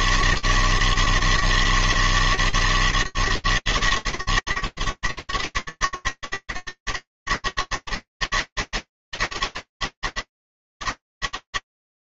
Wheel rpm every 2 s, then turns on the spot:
140, 160, 150, 150, 160, 160.
none